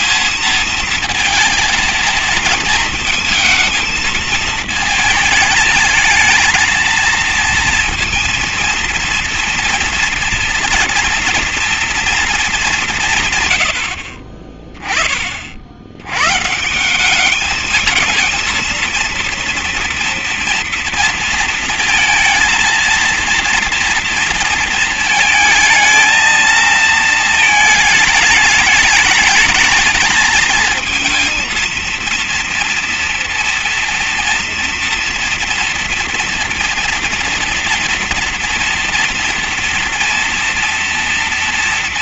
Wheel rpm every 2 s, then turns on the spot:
230, 230, 220, 220, 230, 230, 220, 30, 140, 230, 230, 230, 230, 230, 210, 230, 230, 230, 240, 230, 230.
none